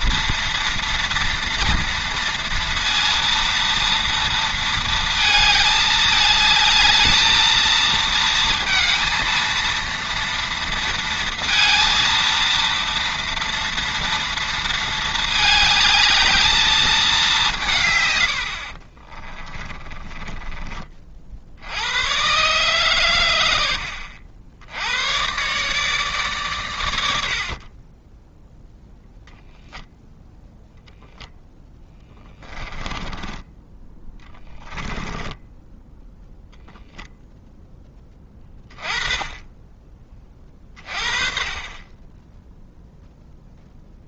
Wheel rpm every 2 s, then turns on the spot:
240, 230, 230, 220, 230, 230, 230, 220, 210, 40, 30, 120, 90, 100, 10, 0, 20, 10, 0, 20, 40, 0.
18-20 32-36